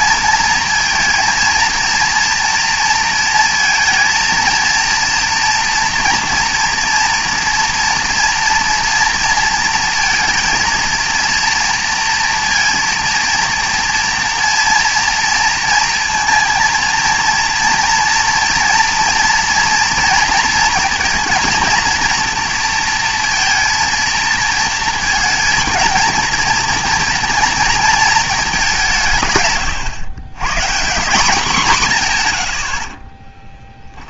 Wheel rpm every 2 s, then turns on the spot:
230, 230, 230, 230, 230, 230, 230, 230, 230, 230, 230, 230, 230, 240, 200, 150, 80.
none